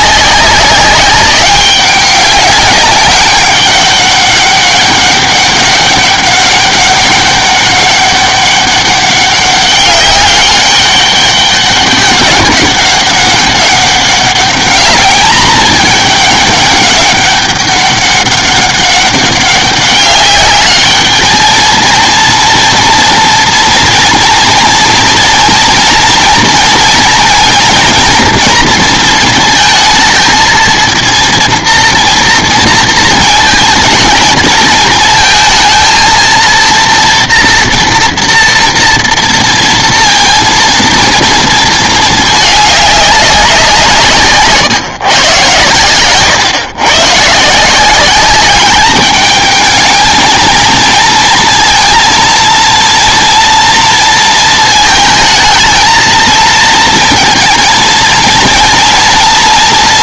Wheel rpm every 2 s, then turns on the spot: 200, 200, 200, 200, 200, 200, 200, 210, 200, 200, 210, 230, 230, 230, 230, 230, 230, 220, 230, 230, 230, 210, 150, 130, 200, 220, 240, 220, 230, 230.
none